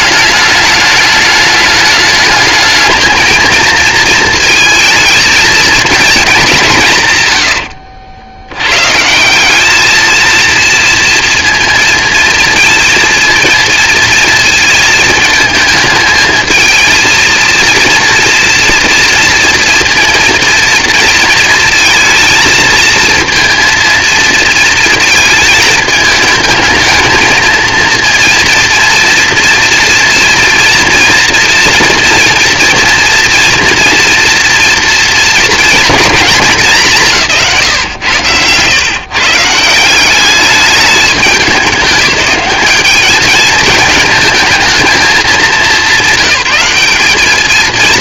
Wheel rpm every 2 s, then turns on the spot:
210, 220, 230, 200, 100, 230, 230, 230, 220, 230, 230, 220, 230, 220, 230, 230, 230, 230, 210, 120, 210, 200, 220, 200.
none